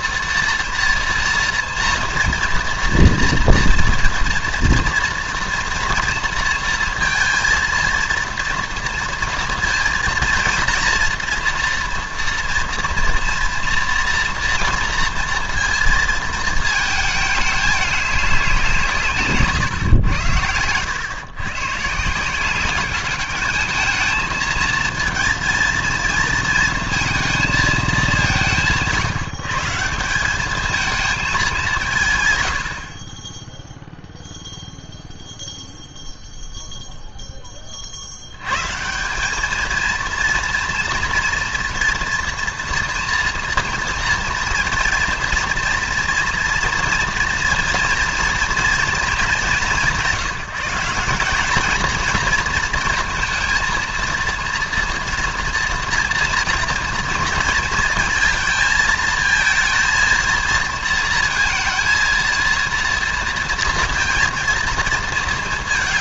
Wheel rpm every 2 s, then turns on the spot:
240, 230, 230, 230, 230, 240, 230, 230, 220, 180, 90, 180, 220, 230, 170, 210, 90, 0, 0, 140, 230, 240, 230, 240, 230, 180, 230, 230, 230, 230, 230, 230, 230.
none